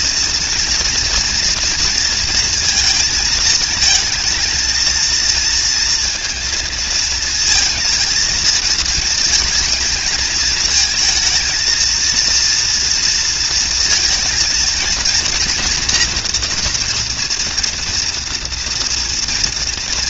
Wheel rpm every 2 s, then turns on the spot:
230, 220, 230, 230, 220, 230, 230, 240, 240, 230.
none